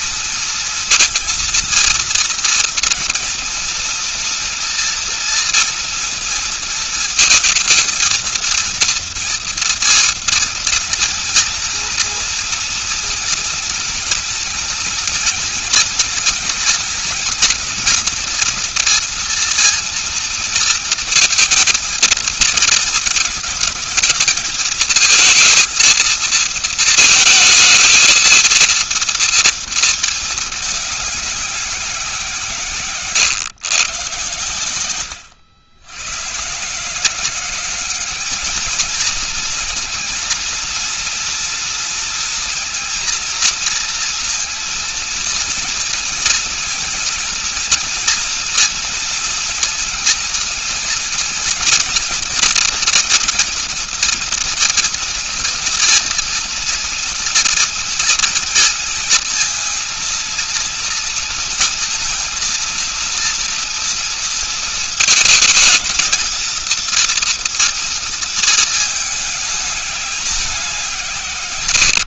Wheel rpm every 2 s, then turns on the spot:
230, 230, 230, 230, 230, 230, 230, 230, 230, 230, 230, 230, 220, 220, 230, 200, 130, 100, 160, 220, 230, 230, 230, 230, 230, 230, 230, 230, 230, 230, 230, 230, 220, 230, 220, 180.
none